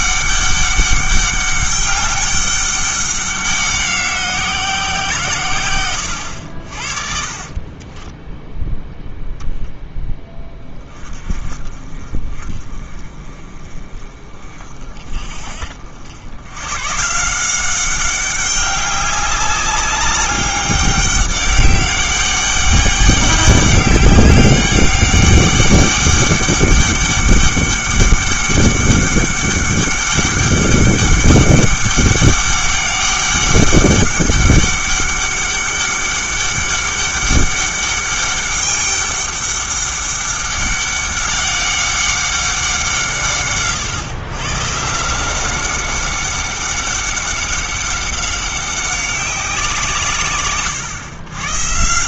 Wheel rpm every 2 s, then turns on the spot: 200, 200, 180, 60, 0, 20, 30, 40, 120, 200, 200, 200, 200, 200, 200, 200, 200, 200, 200, 200, 200, 180, 140, 200, 190, 120.
none